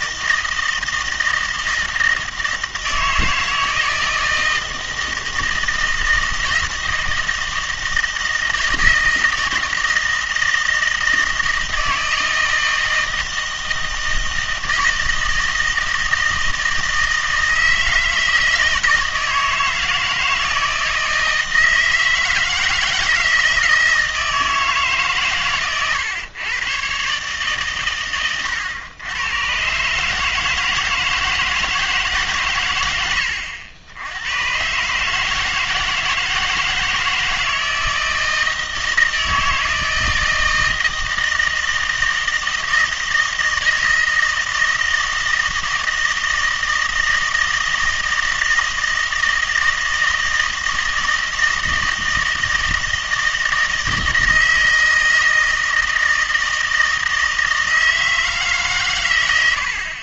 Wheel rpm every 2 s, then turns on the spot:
160, 160, 160, 160, 160, 160, 160, 160, 160, 160, 160, 160, 160, 120, 110, 160, 120, 130, 160, 160, 160, 160, 160, 160, 160, 160, 160, 160, 160, 150.
none